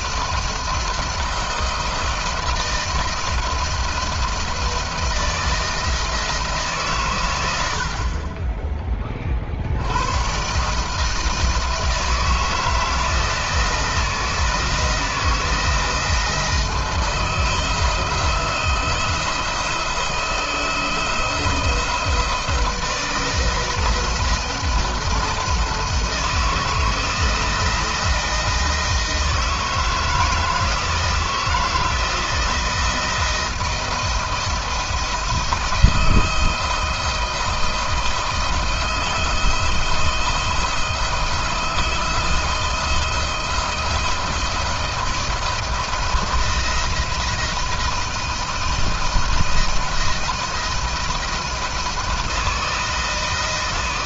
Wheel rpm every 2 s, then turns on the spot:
170, 170, 170, 120, 30, 150, 160, 170, 170, 160, 160, 170, 170, 160, 160, 160, 170, 170, 170, 160, 170, 160, 170, 170, 160, 170, 160.
none